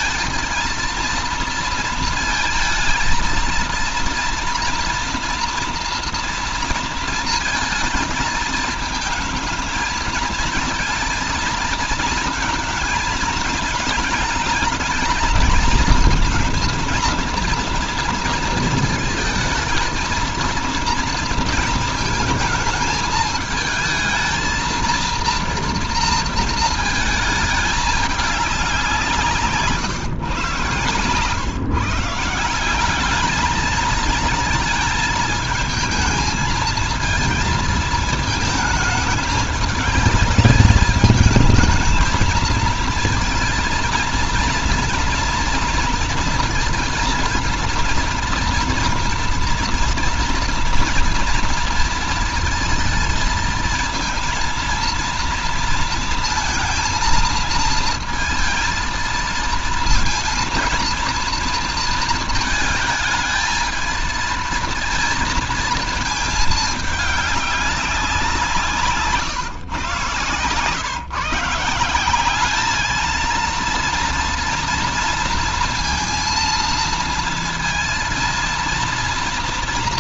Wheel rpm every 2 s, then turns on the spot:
230, 220, 230, 230, 220, 230, 220, 210, 230, 230, 230, 220, 230, 220, 190, 120, 190, 220, 220, 210, 210, 220, 230, 230, 230, 230, 220, 230, 230, 230, 230, 220, 230, 210, 170, 130, 210, 230, 230, 230.
30-32